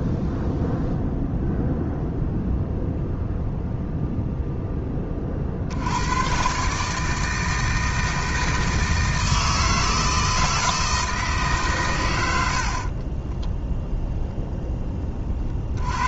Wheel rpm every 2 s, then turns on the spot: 0, 0, 10, 140, 160, 160, 40, 10.
12-14